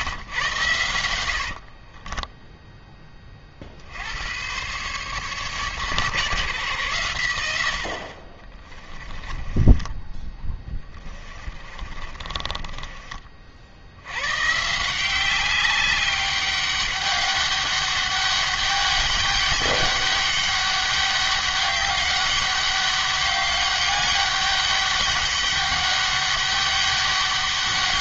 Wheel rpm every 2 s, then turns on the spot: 100, 10, 130, 130, 20, 20, 30, 160, 200, 200, 200, 200, 200, 200.
8-14